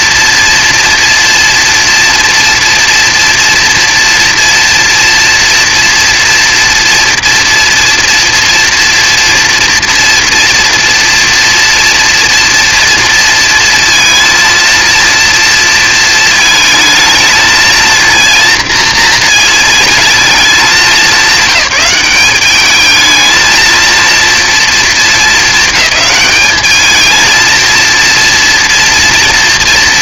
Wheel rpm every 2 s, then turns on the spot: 240, 230, 230, 230, 240, 230, 230, 230, 220, 230, 200, 200, 230, 220, 230.
none